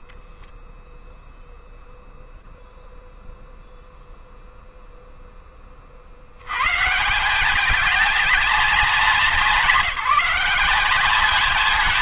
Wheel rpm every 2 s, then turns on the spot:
0, 0, 50, 220, 200, 190.
none